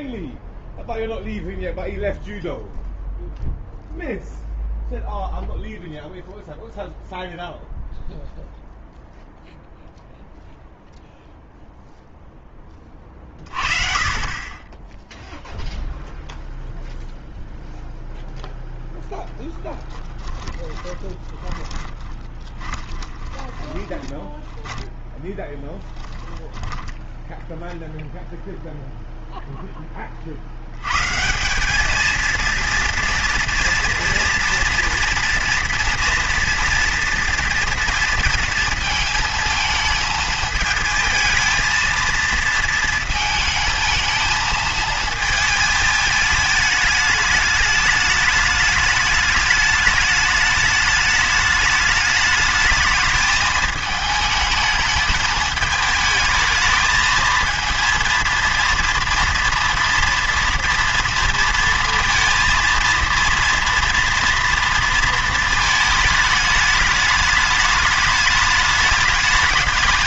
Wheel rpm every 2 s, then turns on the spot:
0, 0, 0, 0, 0, 0, 10, 20, 0, 0, 20, 20, 10, 10, 0, 100, 230, 240, 230, 230, 220, 230, 220, 210, 210, 210, 210, 220, 220, 230, 230, 230, 230, 210, 210.
20-28